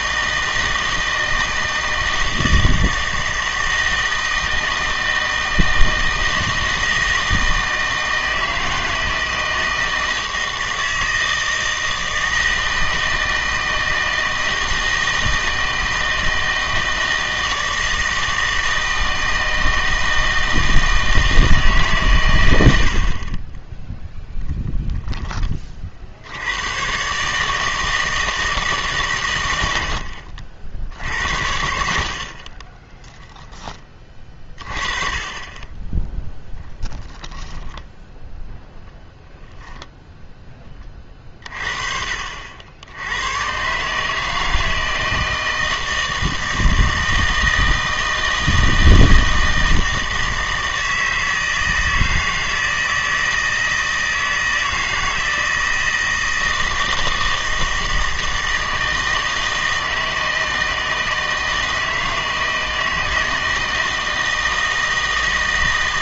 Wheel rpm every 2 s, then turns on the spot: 160, 160, 160, 160, 160, 160, 160, 160, 160, 160, 160, 80, 0, 110, 150, 60, 30, 30, 0, 0, 20, 80, 160, 160, 160, 160, 160, 160, 160, 160, 160, 160, 160.
32-34